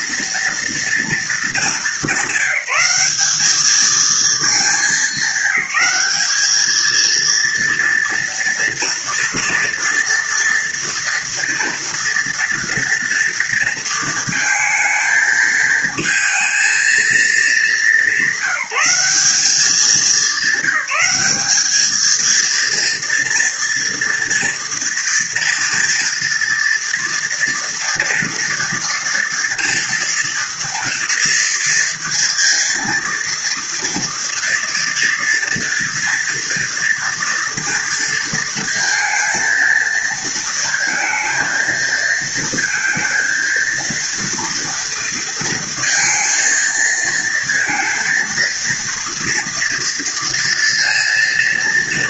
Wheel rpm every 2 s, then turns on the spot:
230, 190, 220, 210, 230, 230, 230, 220, 220, 200, 200, 230, 230, 230, 230, 230, 230, 230, 230, 230, 230, 230, 230, 230, 230, 230.
none